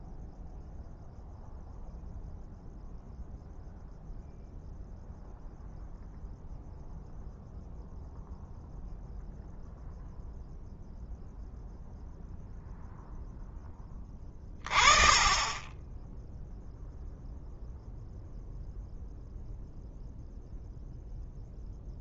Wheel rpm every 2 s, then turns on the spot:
0, 0, 0, 0, 0, 0, 0, 30, 0, 0, 0.
none